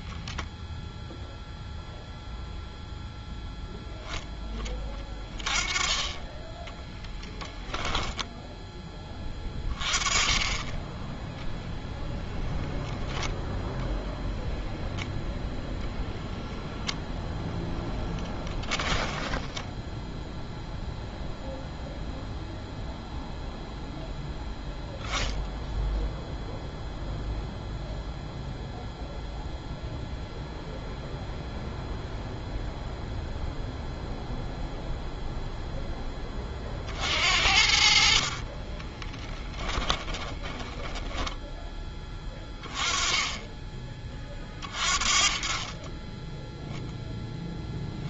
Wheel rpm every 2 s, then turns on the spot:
0, 0, 10, 10, 10, 20, 0, 0, 0, 10, 0, 0, 0, 0, 0, 0, 0, 0, 40, 30, 10, 20, 30, 0.
18-20 38-42